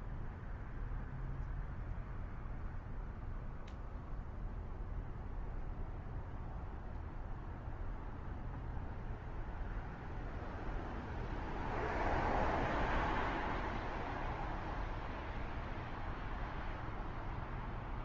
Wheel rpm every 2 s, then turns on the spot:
0, 0, 0, 0, 0, 0, 0, 0, 0.
none